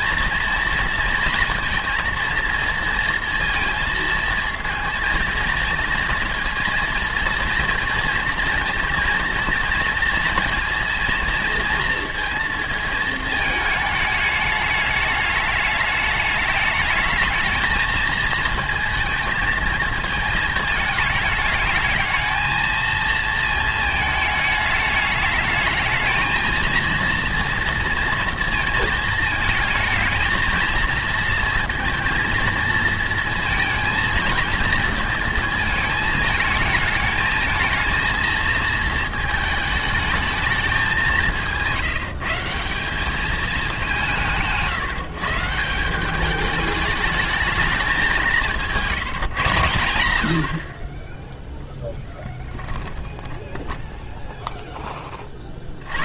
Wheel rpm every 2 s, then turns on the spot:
230, 230, 230, 230, 230, 230, 230, 210, 210, 230, 220, 220, 220, 230, 230, 230, 230, 230, 220, 230, 200, 180, 150, 210, 170, 50, 10, 0.
48-50 52-54